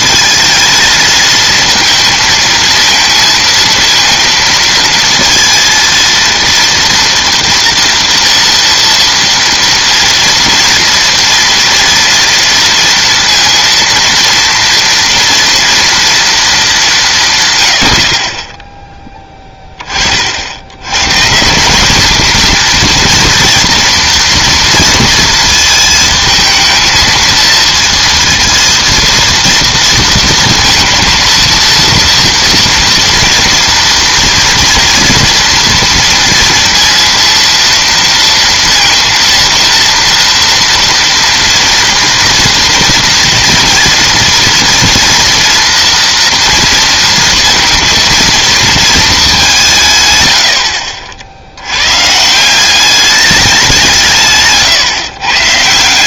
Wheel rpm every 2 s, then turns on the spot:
220, 230, 230, 230, 230, 230, 230, 230, 220, 20, 80, 230, 230, 220, 230, 230, 230, 230, 230, 230, 230, 230, 230, 230, 220, 70, 170, 140.
none